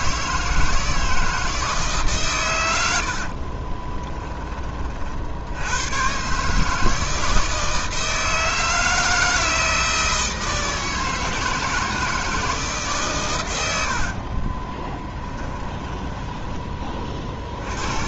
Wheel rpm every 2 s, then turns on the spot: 160, 90, 40, 160, 160, 160, 150, 20, 30.
14-16